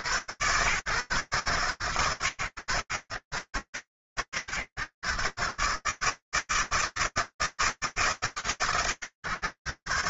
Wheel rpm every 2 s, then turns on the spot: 130, 100, 120, 160, 150.
none